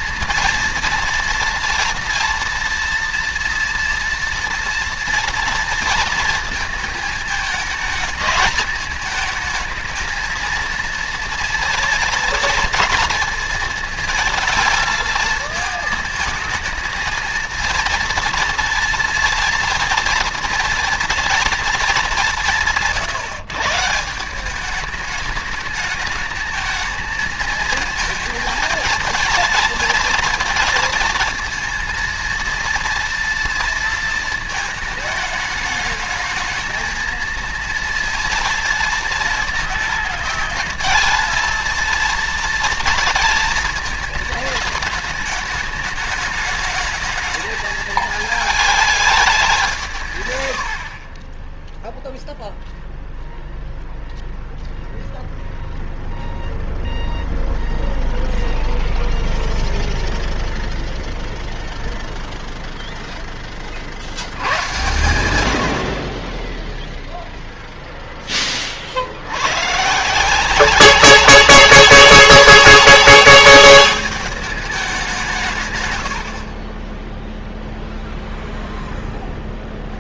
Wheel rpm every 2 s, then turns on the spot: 230, 230, 230, 220, 210, 230, 230, 220, 220, 230, 230, 160, 210, 220, 220, 230, 230, 220, 220, 230, 220, 230, 210, 210, 210, 50, 0, 0, 0, 0, 0, 0, 120, 0, 60, 190, 200, 190, 10, 0.
50-52